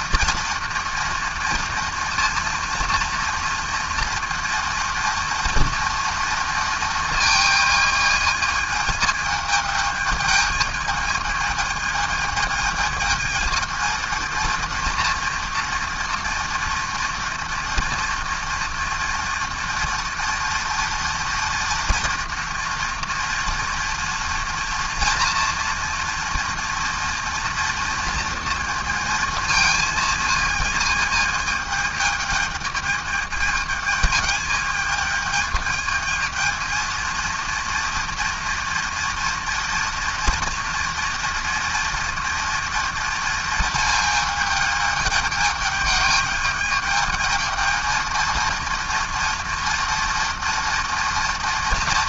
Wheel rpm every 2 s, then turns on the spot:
230, 230, 230, 230, 220, 220, 220, 230, 230, 240, 230, 230, 230, 230, 230, 220, 220, 210, 220, 240, 240, 230, 220, 220, 230, 230.
none